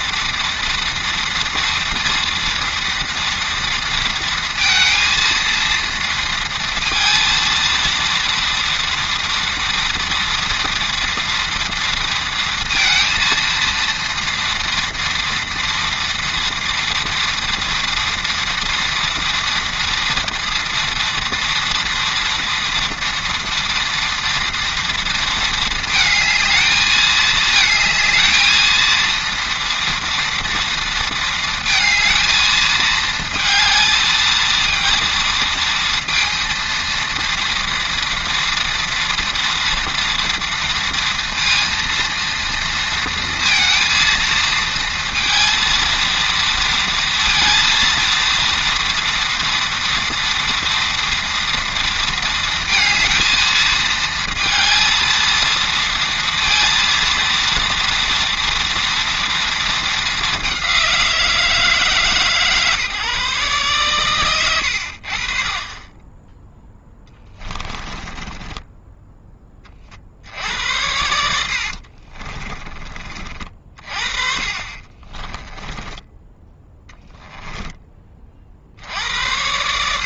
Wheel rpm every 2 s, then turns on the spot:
230, 240, 230, 230, 230, 230, 230, 230, 230, 230, 230, 230, 230, 220, 230, 230, 220, 230, 230, 230, 230, 230, 230, 230, 230, 230, 230, 230, 230, 230, 190, 140, 70, 10, 10, 80, 30, 30, 10, 70.
66-68 74-76